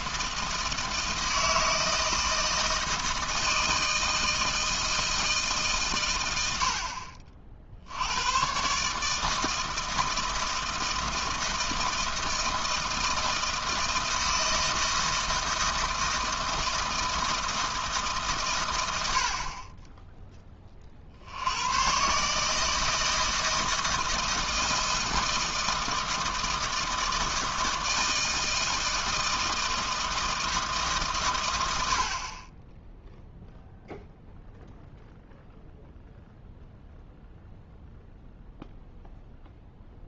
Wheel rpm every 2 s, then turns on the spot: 160, 160, 160, 70, 140, 160, 160, 160, 160, 120, 30, 160, 160, 160, 160, 150, 10, 0, 0, 0.
none